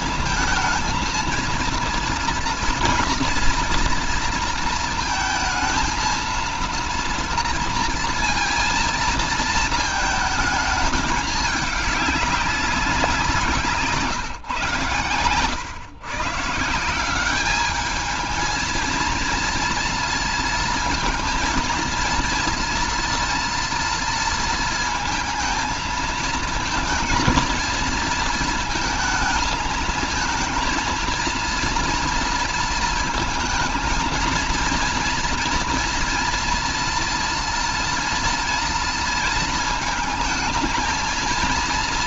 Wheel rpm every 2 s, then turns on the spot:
220, 240, 230, 230, 230, 220, 180, 130, 180, 230, 230, 230, 230, 230, 220, 230, 230, 230, 230, 230, 220.
none